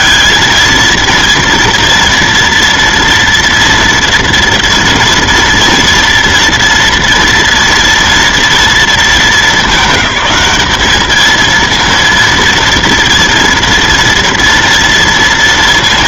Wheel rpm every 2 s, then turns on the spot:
230, 230, 230, 230, 230, 210, 230, 240.
none